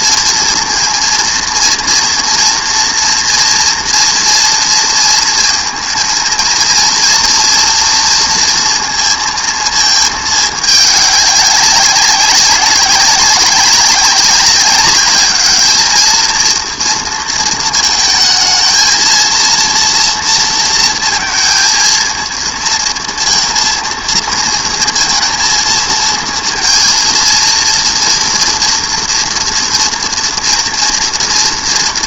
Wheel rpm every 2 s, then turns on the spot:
230, 230, 230, 230, 230, 210, 190, 200, 230, 230, 230, 230, 230, 230, 230, 240.
none